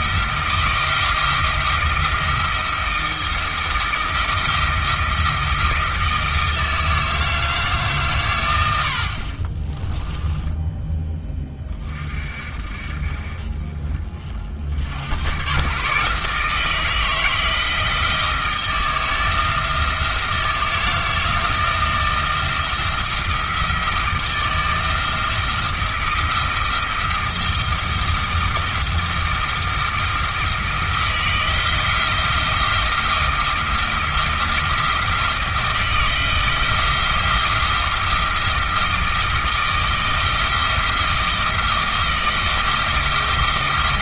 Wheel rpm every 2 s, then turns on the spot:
170, 160, 160, 160, 80, 10, 40, 70, 160, 160, 170, 170, 170, 170, 170, 160, 170, 170, 170, 160, 170, 170.
none